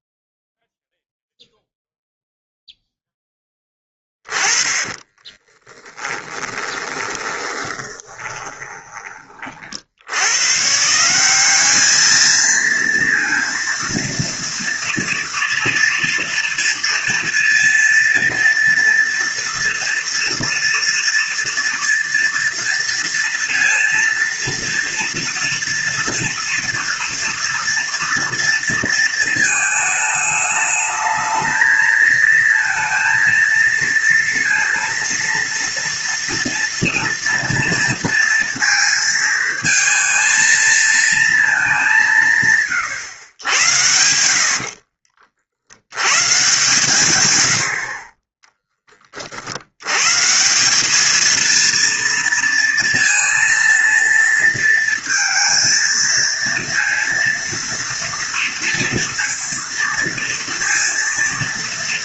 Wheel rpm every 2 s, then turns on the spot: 0, 0, 20, 20, 10, 140, 230, 230, 230, 230, 230, 230, 230, 230, 230, 220, 230, 230, 240, 230, 230, 140, 50, 140, 10, 180, 230, 230, 230, 230, 230.
4-10 44-46